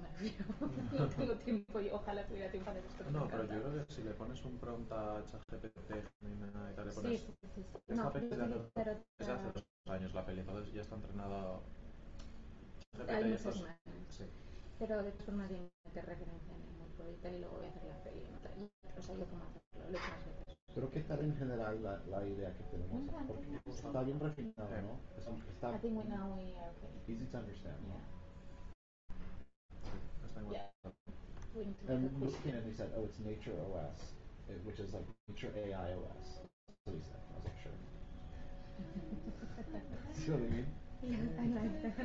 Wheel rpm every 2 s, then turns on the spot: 0, 0, 0, 0, 0, 0, 0, 0, 0, 0, 0, 0, 0, 0, 0, 0, 0, 0, 0, 0, 0.
none